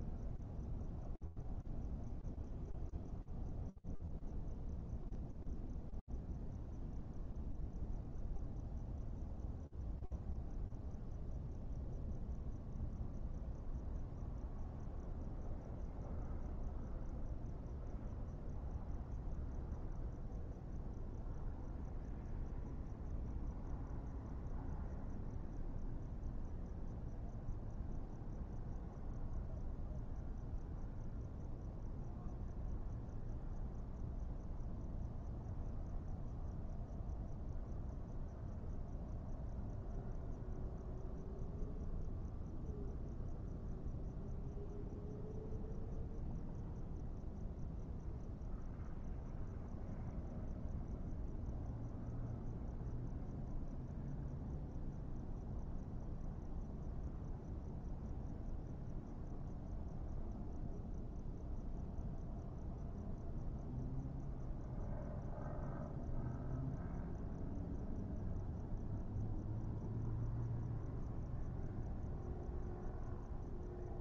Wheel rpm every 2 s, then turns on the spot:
0, 0, 0, 0, 0, 0, 0, 0, 0, 0, 0, 0, 0, 0, 0, 0, 0, 0, 0, 0, 0, 0, 0, 0, 0, 0, 0, 0, 0, 0, 0, 0, 0, 0, 0, 0, 0.
none